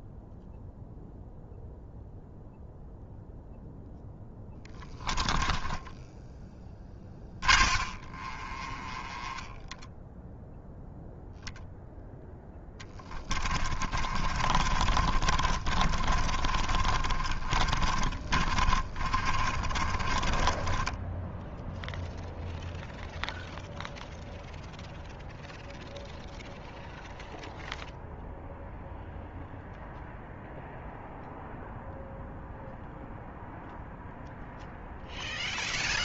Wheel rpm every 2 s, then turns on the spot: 0, 0, 20, 20, 10, 0, 20, 30, 30, 30, 10, 0, 0, 0, 0, 0, 0, 0.
4-8 12-22